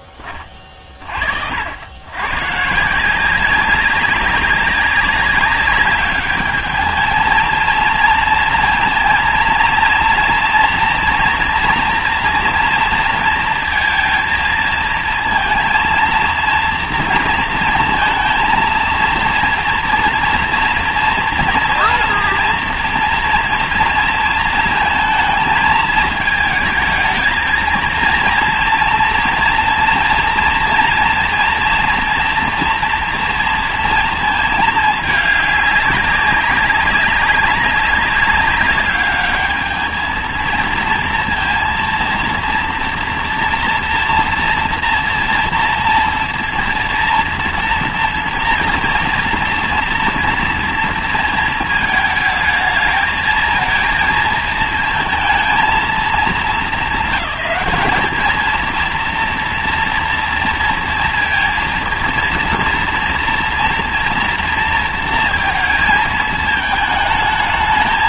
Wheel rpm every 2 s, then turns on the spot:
20, 140, 190, 210, 230, 230, 230, 230, 230, 230, 230, 230, 230, 220, 230, 240, 230, 220, 200, 200, 230, 230, 230, 230, 230, 230, 220, 220, 220, 220, 230, 230, 230, 220.
none